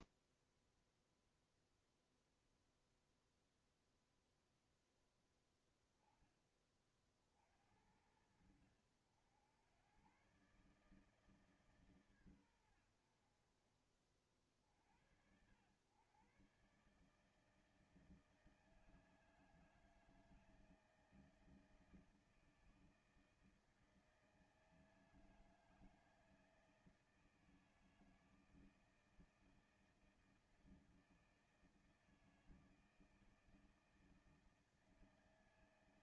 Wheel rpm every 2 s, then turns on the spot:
0, 0, 0, 20, 70, 120, 120, 50, 120, 160, 160, 160, 160, 160, 160, 160, 160, 160.
none